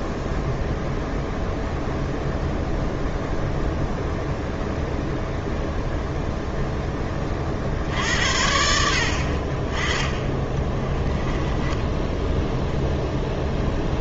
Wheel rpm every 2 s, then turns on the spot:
0, 0, 0, 10, 70, 10, 0.
10-12